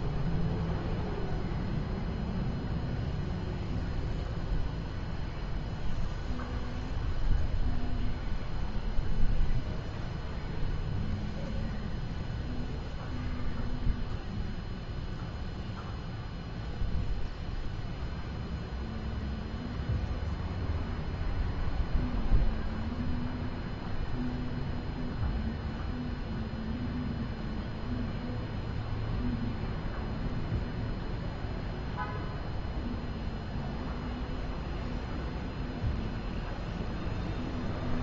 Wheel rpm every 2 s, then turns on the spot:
0, 0, 0, 0, 0, 0, 0, 0, 0, 0, 0, 0, 0, 0, 0, 0, 0, 0, 0.
none